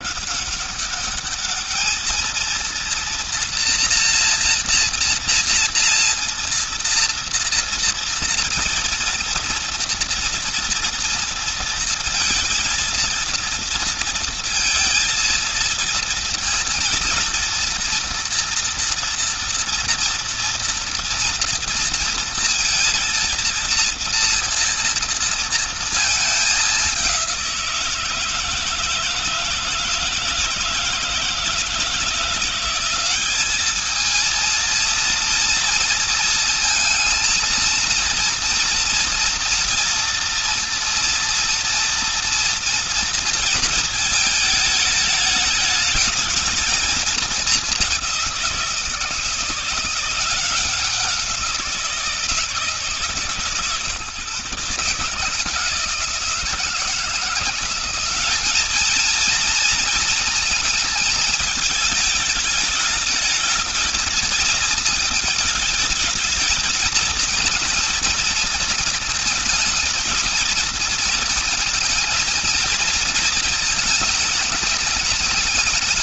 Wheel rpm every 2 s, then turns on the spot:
200, 230, 230, 230, 230, 230, 230, 230, 230, 230, 230, 230, 230, 190, 160, 160, 190, 230, 230, 230, 230, 230, 210, 220, 170, 180, 150, 140, 170, 220, 220, 220, 220, 220, 220, 220, 220, 210.
none